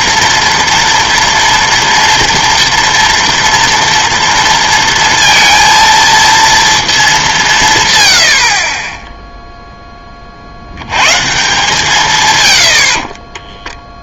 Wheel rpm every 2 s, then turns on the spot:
230, 230, 230, 220, 40, 70, 90.
none